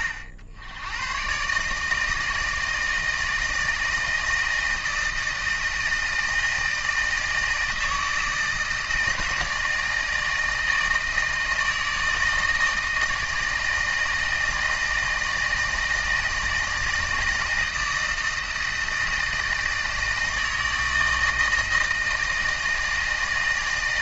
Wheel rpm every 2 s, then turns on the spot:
80, 160, 160, 160, 160, 160, 160, 160, 160, 160, 160, 160.
none